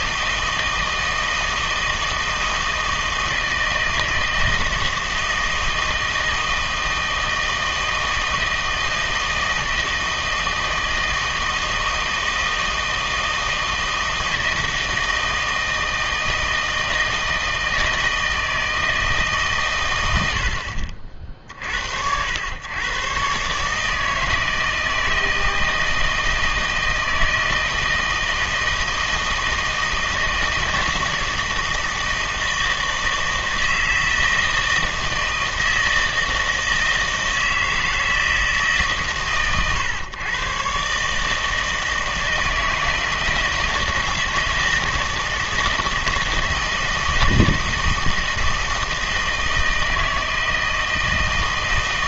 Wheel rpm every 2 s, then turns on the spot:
160, 160, 160, 160, 160, 160, 160, 160, 160, 160, 50, 110, 160, 160, 160, 170, 160, 160, 160, 150, 130, 160, 160, 160, 160, 160.
none